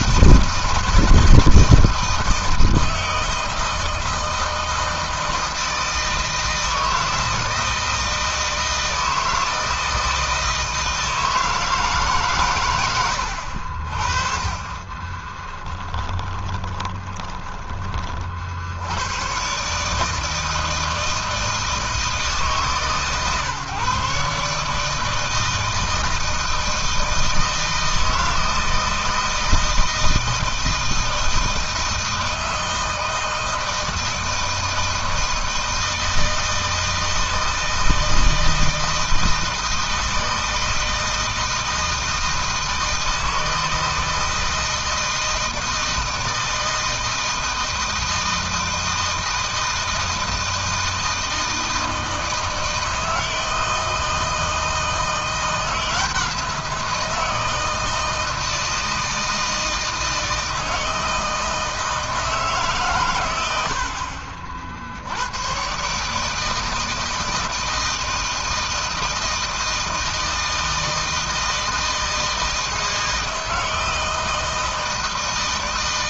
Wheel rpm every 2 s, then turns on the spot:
160, 160, 160, 160, 160, 160, 140, 50, 20, 50, 160, 160, 150, 160, 160, 160, 160, 160, 160, 160, 160, 160, 160, 160, 160, 160, 160, 160, 170, 160, 160, 150, 60, 150, 160, 160, 160, 160.
16-18